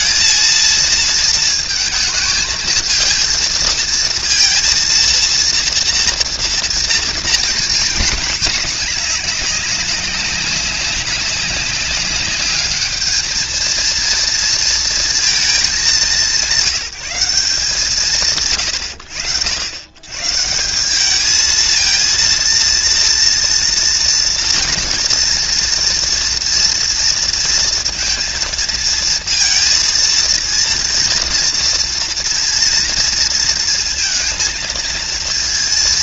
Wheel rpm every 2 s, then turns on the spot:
230, 220, 230, 240, 210, 200, 210, 230, 170, 90, 160, 230, 230, 230, 230, 230, 230, 230.
none